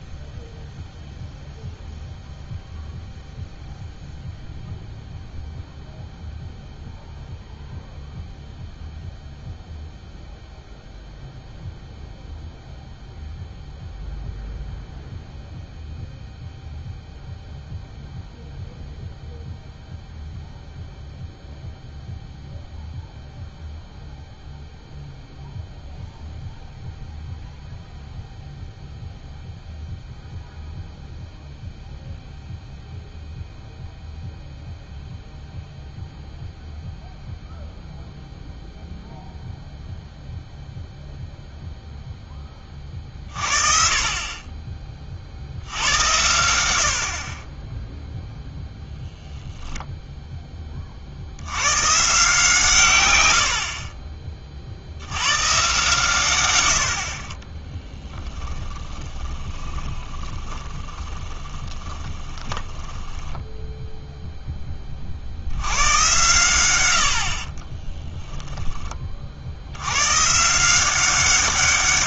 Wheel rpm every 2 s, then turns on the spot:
0, 0, 0, 0, 0, 0, 0, 0, 0, 0, 0, 0, 0, 0, 0, 0, 0, 0, 0, 0, 0, 20, 20, 80, 0, 20, 150, 40, 90, 10, 20, 20, 10, 100, 20, 170.
58-64